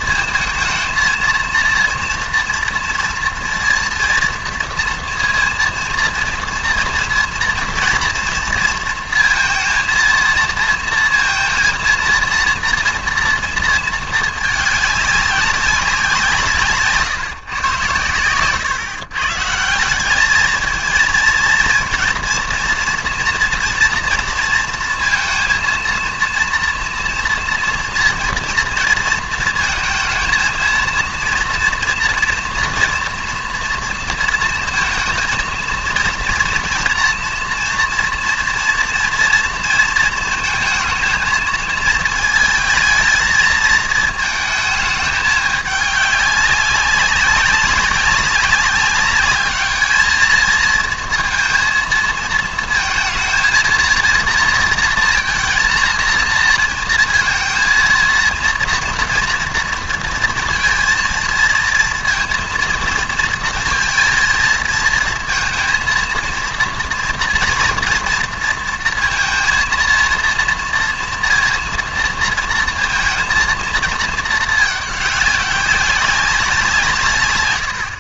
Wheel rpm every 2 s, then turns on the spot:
230, 230, 230, 230, 230, 230, 230, 210, 160, 120, 220, 230, 230, 230, 230, 220, 240, 230, 240, 230, 230, 220, 220, 200, 200, 220, 220, 230, 230, 230, 230, 230, 220, 230, 230, 230, 230, 210, 180.
none